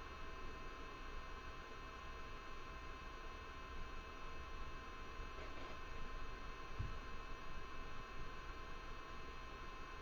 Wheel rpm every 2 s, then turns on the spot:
0, 0, 0, 0, 0.
none